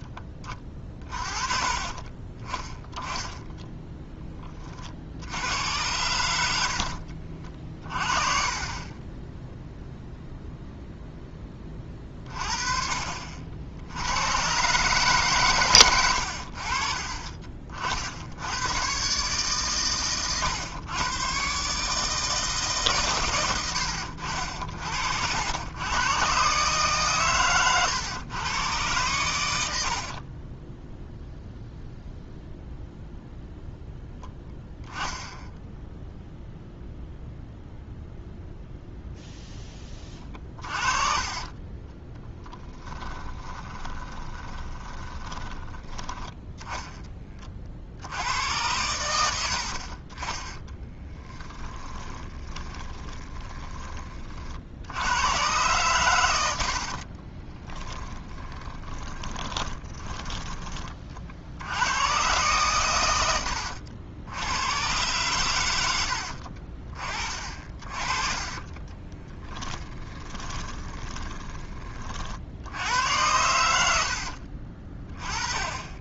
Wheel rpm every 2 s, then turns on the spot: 30, 10, 40, 60, 30, 0, 40, 130, 50, 120, 120, 140, 60, 140, 110, 10, 0, 10, 0, 0, 30, 10, 20, 10, 100, 10, 20, 80, 50, 20, 30, 110, 110, 40, 20, 20, 80, 40.
0-2 30-32 34-36 42-46 50-54 56-60 68-72